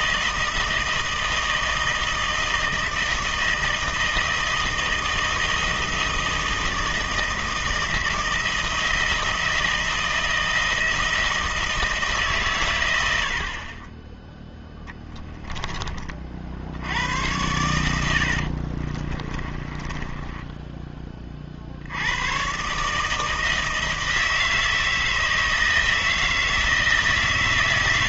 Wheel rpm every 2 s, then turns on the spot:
160, 160, 160, 160, 160, 160, 100, 10, 80, 50, 20, 140, 160, 160.
18-20